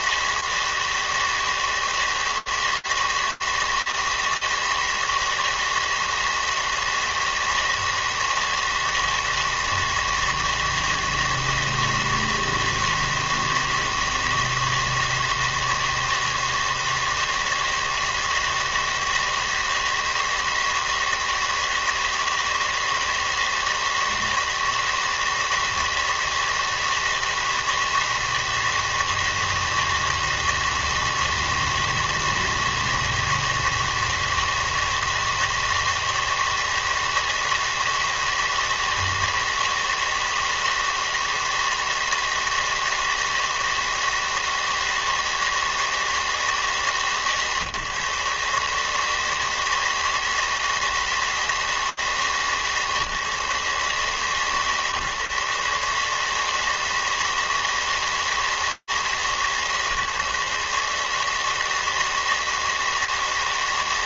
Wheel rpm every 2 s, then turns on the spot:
160, 160, 160, 160, 160, 160, 160, 160, 160, 160, 160, 160, 160, 160, 160, 160, 160, 160, 160, 160, 160, 160, 160, 130, 160, 150, 140, 150, 160, 150, 160, 160.
none